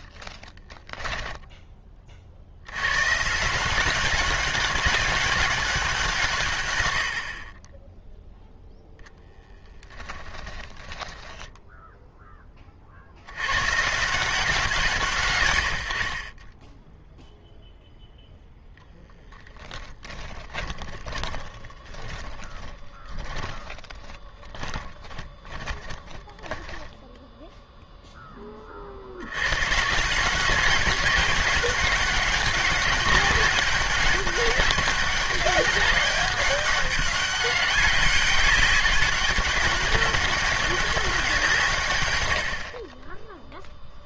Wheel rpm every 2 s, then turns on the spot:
30, 100, 200, 90, 0, 20, 50, 150, 10, 0, 20, 10, 20, 10, 40, 190, 200, 200, 200, 200, 200, 40.
0-2 10-12 20-28